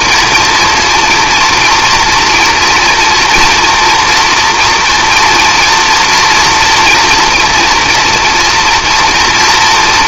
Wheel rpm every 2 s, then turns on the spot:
230, 240, 240, 230, 230.
none